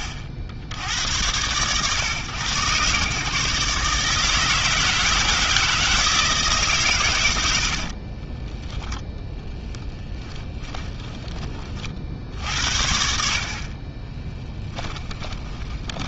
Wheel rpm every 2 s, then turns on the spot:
70, 120, 160, 140, 10, 20, 70, 20.
10-12 14-16